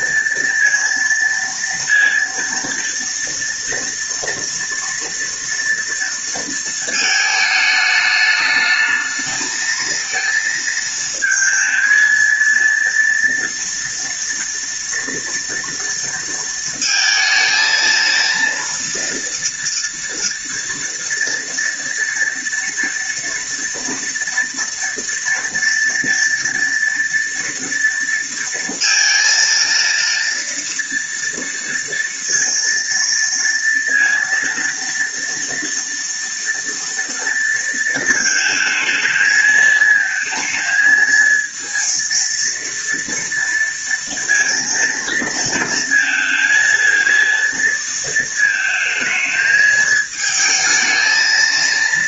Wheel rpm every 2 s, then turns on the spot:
230, 230, 230, 230, 210, 230, 230, 230, 230, 230, 230, 230, 230, 230, 230, 230, 230, 230, 230, 220, 220, 230, 230, 230, 220, 220.
none